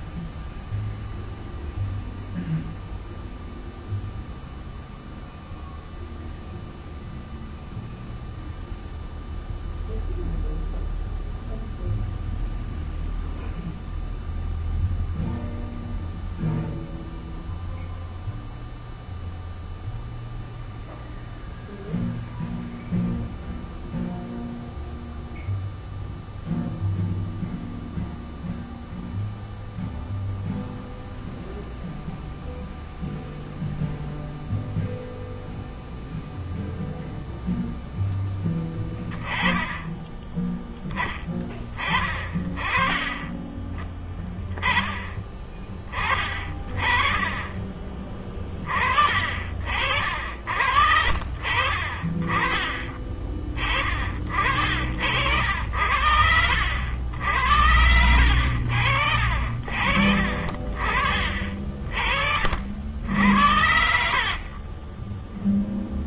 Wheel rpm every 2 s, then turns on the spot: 0, 0, 0, 0, 0, 0, 0, 0, 0, 0, 0, 0, 0, 0, 0, 0, 0, 0, 0, 10, 10, 20, 10, 40, 20, 60, 30, 50, 60, 80, 50, 60, 40.
46-48